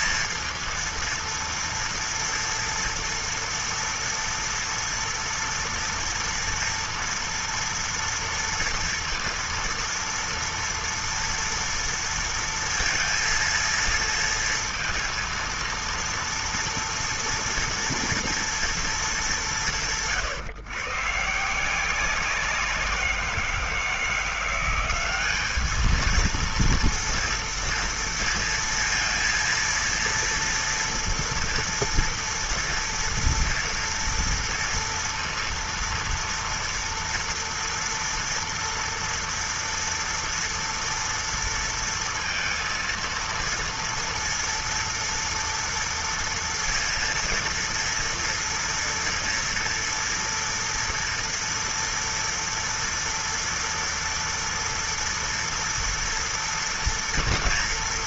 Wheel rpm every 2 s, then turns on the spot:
230, 230, 230, 230, 230, 230, 230, 230, 230, 230, 150, 180, 170, 220, 230, 230, 230, 230, 230, 230, 230, 230, 230, 230, 230, 230, 240, 230, 230.
none